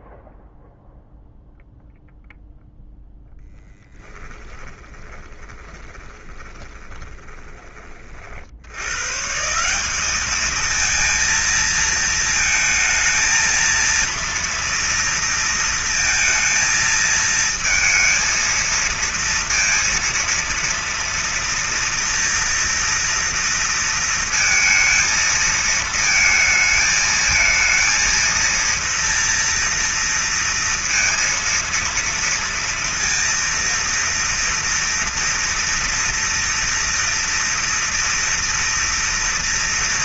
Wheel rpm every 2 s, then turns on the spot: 0, 0, 10, 20, 110, 230, 220, 230, 230, 230, 230, 230, 230, 220, 230, 230, 230, 230, 230, 230.
4-8